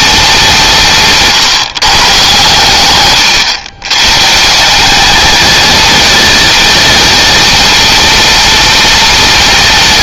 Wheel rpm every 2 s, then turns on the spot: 150, 110, 190, 210, 210.
2-4